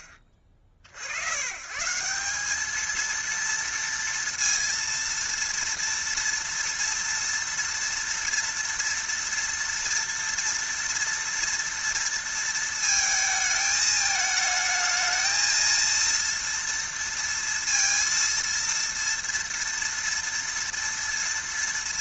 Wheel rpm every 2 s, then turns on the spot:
50, 230, 230, 230, 230, 230, 220, 220, 230, 230, 230.
none